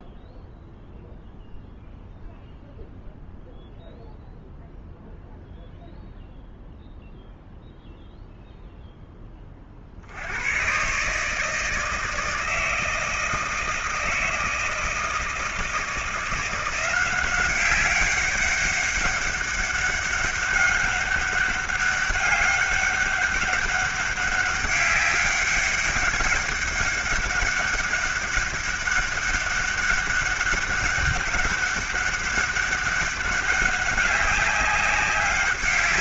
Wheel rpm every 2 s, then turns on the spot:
0, 0, 0, 0, 0, 120, 160, 160, 170, 200, 200, 200, 200, 200, 200, 200, 200, 200.
none